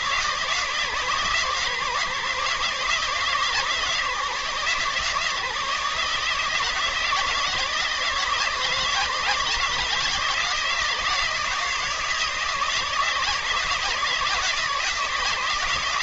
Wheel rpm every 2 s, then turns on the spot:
150, 150, 160, 160, 160, 160, 160, 170.
none